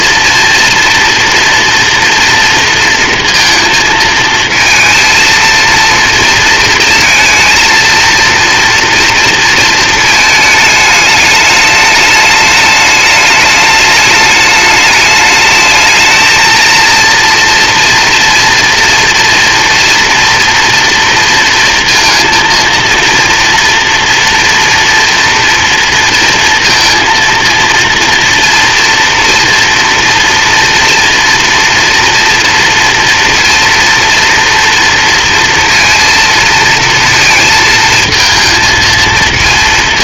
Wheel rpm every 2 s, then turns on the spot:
230, 230, 230, 230, 230, 210, 210, 220, 230, 230, 230, 240, 230, 230, 230, 230, 230, 230, 220, 230.
none